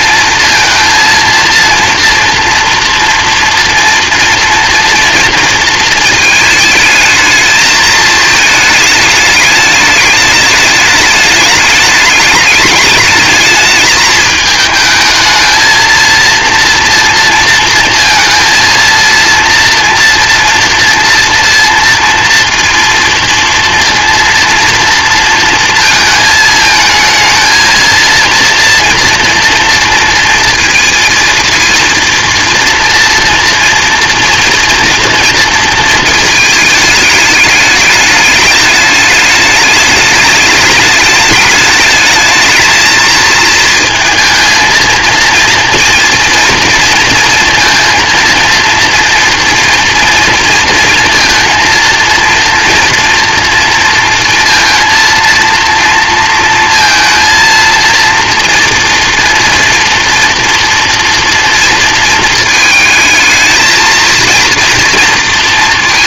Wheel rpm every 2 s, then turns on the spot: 230, 240, 230, 220, 220, 210, 210, 220, 230, 230, 230, 230, 230, 220, 240, 230, 230, 230, 220, 210, 210, 220, 230, 230, 230, 230, 230, 230, 230, 230, 230, 220, 230.
none